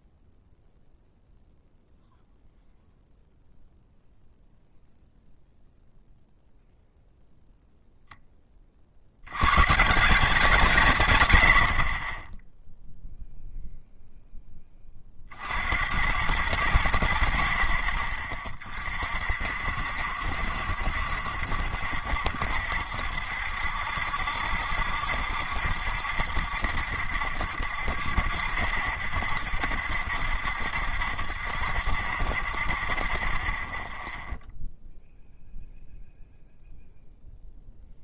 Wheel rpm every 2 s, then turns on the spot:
0, 0, 0, 0, 30, 170, 0, 20, 90, 30, 70, 70, 70, 70, 70, 70, 40, 0, 0.
none